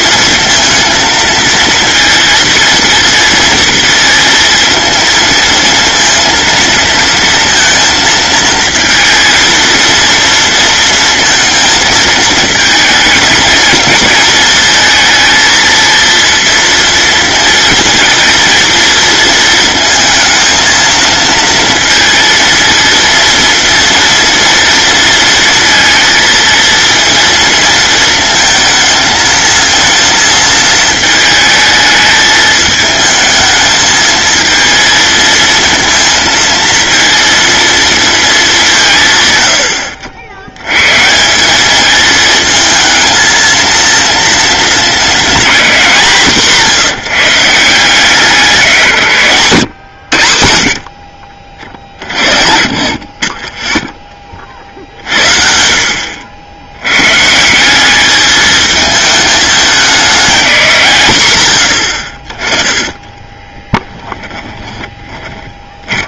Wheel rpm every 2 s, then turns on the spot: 230, 230, 230, 230, 220, 230, 220, 230, 230, 230, 230, 230, 230, 230, 220, 220, 220, 230, 230, 160, 140, 220, 220, 160, 160, 50, 40, 50, 110, 220, 150, 10, 20.
64-66